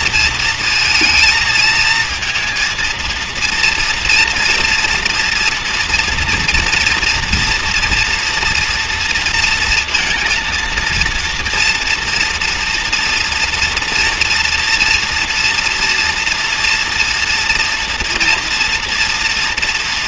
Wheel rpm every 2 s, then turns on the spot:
230, 230, 230, 240, 230, 230, 230, 240, 230, 230.
none